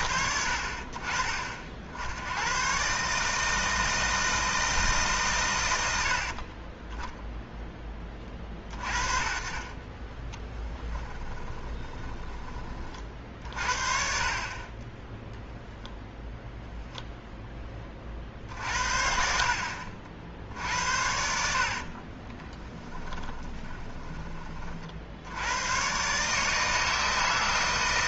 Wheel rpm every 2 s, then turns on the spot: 50, 110, 160, 20, 30, 20, 30, 30, 0, 60, 70, 20, 30, 150.
6-8 10-12 22-24